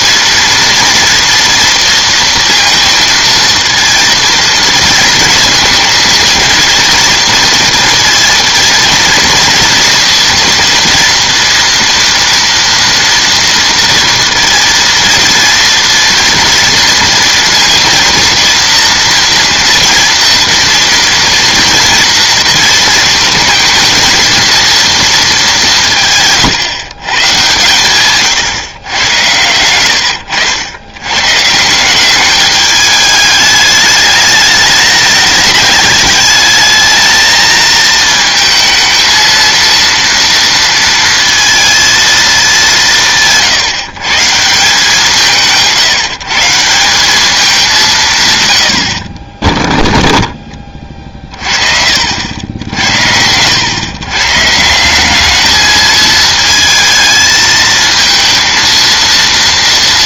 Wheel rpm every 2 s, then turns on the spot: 230, 230, 220, 230, 230, 230, 230, 230, 230, 240, 230, 230, 230, 150, 120, 80, 210, 210, 220, 220, 230, 190, 160, 160, 100, 20, 80, 160, 220, 230.
none